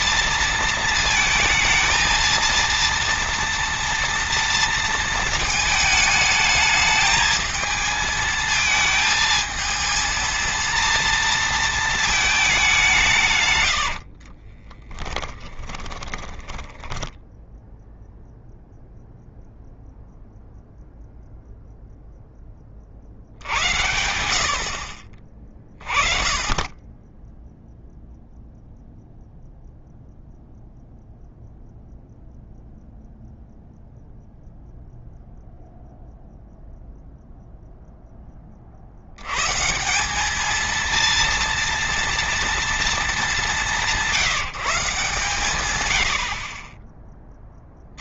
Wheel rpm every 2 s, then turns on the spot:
220, 230, 230, 220, 220, 230, 180, 20, 10, 0, 0, 40, 40, 10, 0, 0, 0, 0, 0, 60, 220, 230, 170, 40.
14-18